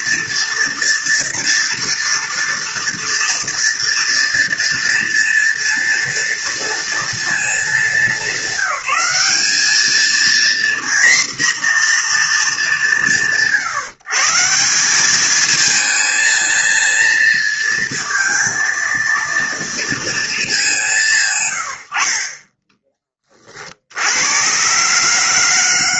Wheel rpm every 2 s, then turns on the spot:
230, 230, 230, 230, 190, 240, 200, 180, 230, 230, 200, 30, 120.
none